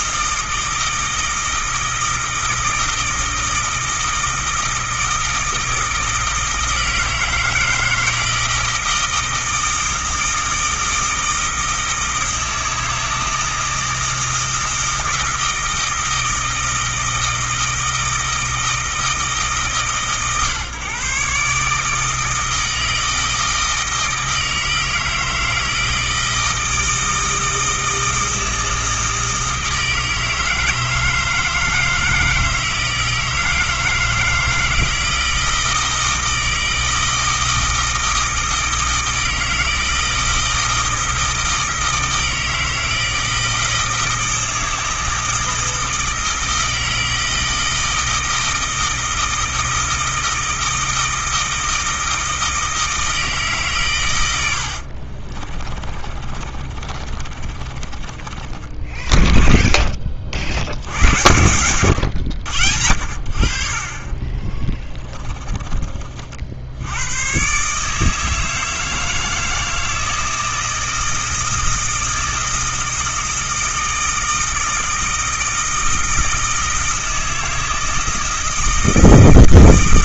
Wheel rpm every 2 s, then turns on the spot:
160, 160, 160, 160, 160, 160, 160, 160, 160, 160, 140, 160, 160, 160, 160, 160, 160, 160, 160, 160, 160, 160, 160, 160, 160, 160, 160, 50, 30, 10, 90, 70, 20, 100, 160, 160, 160, 160, 160, 160.
54-60 64-66